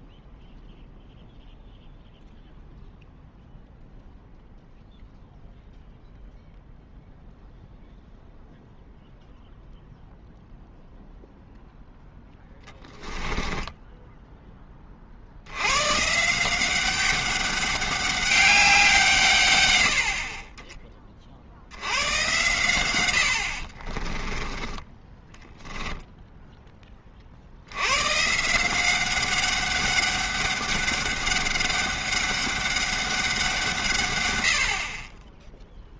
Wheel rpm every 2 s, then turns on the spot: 0, 0, 0, 0, 0, 0, 10, 20, 180, 190, 30, 100, 10, 10, 170, 200, 200, 100.
12-14 24-26